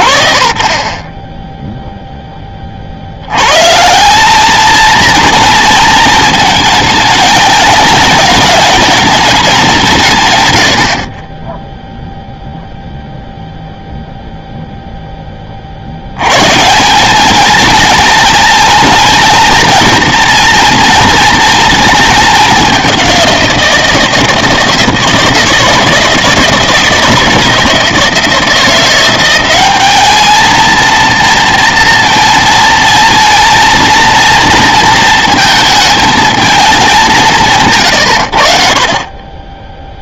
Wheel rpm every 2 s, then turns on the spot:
30, 80, 230, 220, 210, 40, 0, 30, 220, 220, 230, 170, 160, 160, 190, 230, 230, 220, 140, 20.
36-38